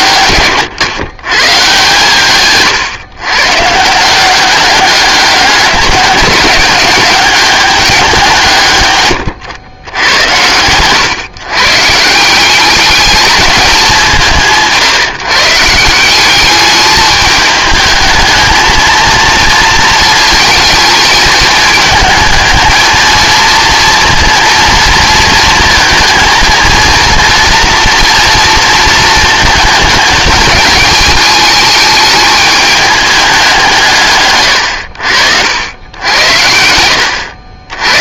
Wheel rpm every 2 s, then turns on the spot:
130, 130, 190, 190, 150, 110, 190, 170, 200, 230, 220, 220, 230, 230, 230, 210, 210, 90, 80.
none